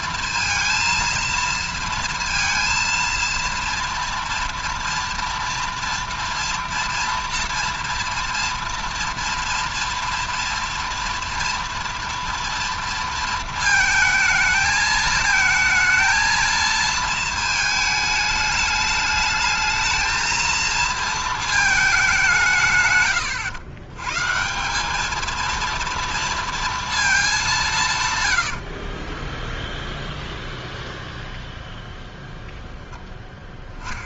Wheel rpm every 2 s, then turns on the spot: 230, 230, 230, 230, 230, 230, 230, 220, 230, 210, 230, 150, 180, 230, 80, 0, 0.
28-30